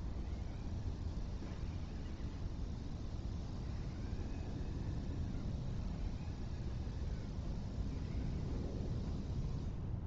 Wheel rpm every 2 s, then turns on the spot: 0, 0, 0, 0, 0.
none